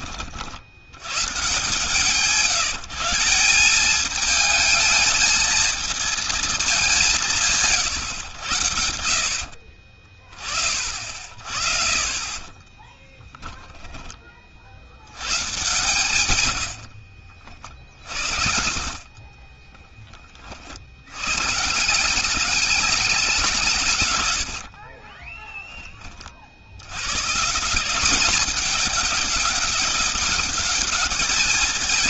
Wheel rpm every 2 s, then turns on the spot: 80, 160, 220, 190, 60, 40, 20, 80, 40, 50, 60, 190, 70, 100, 200, 200.
12-14 16-20 24-26